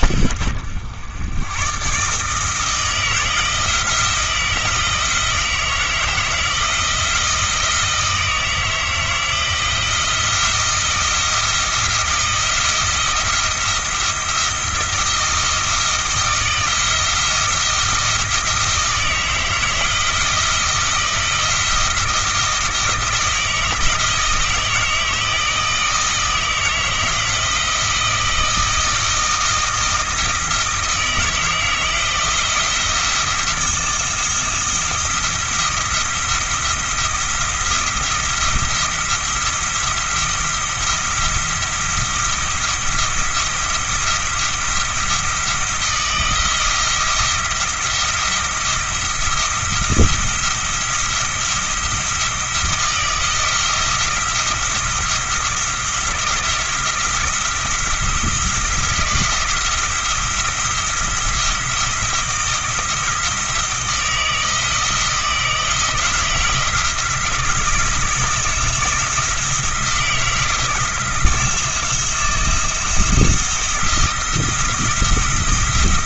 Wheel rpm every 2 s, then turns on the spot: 80, 160, 170, 170, 160, 170, 170, 170, 160, 160, 160, 160, 160, 160, 160, 160, 170, 170, 170, 170, 170, 170, 170, 170, 170, 170, 170, 170, 170, 170, 170, 170, 170, 170, 160, 170, 170, 170.
none